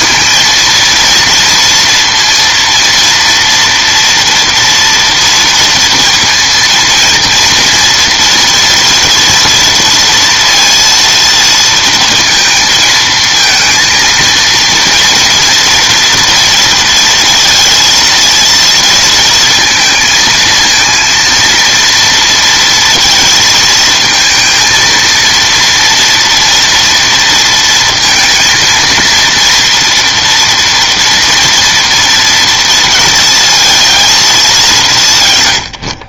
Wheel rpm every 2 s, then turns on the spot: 230, 230, 240, 230, 230, 230, 230, 230, 230, 230, 230, 230, 230, 240, 230, 230, 230, 200.
none